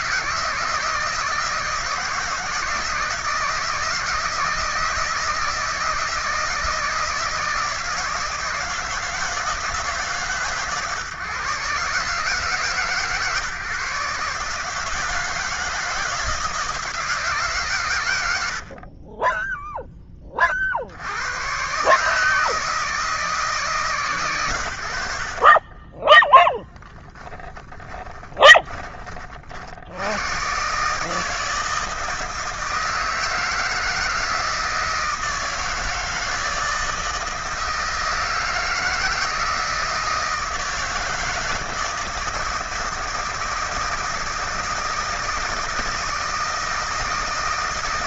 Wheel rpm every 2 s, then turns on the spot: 160, 160, 160, 160, 160, 140, 150, 150, 160, 80, 30, 150, 100, 10, 20, 120, 160, 160, 160, 160, 160, 160, 160, 170.
18-20 28-30